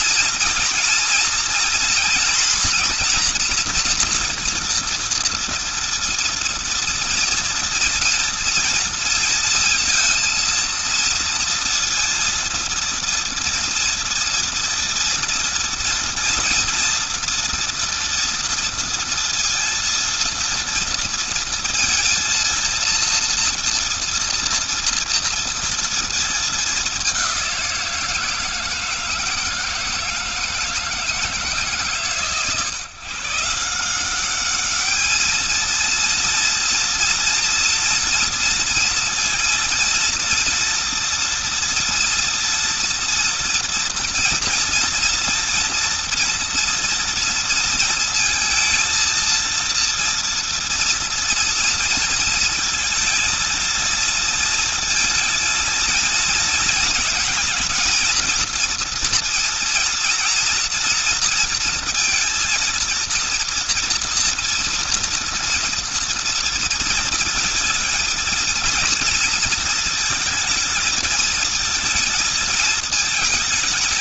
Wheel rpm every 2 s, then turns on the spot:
230, 240, 230, 230, 230, 230, 230, 230, 230, 230, 230, 230, 230, 190, 160, 150, 150, 220, 230, 230, 230, 240, 230, 230, 230, 230, 230, 230, 220, 230, 230, 230, 230, 230, 220, 220, 220.
none